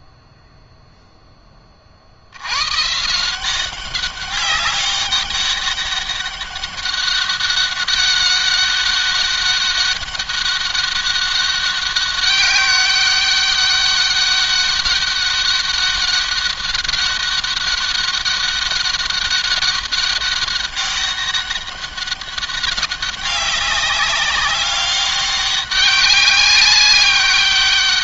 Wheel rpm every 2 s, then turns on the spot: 0, 120, 200, 200, 200, 190, 200, 200, 200, 200, 200, 200, 200, 200.
none